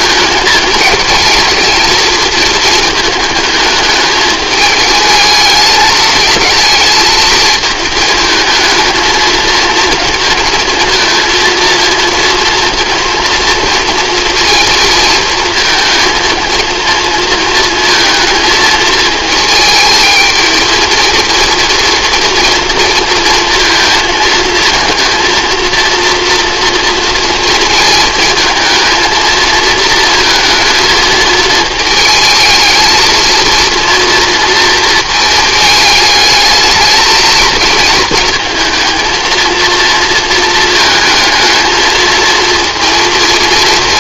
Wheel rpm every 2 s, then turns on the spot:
220, 220, 220, 220, 220, 230, 230, 230, 230, 220, 230, 230, 230, 230, 220, 220, 220, 230, 220, 230, 220, 230.
none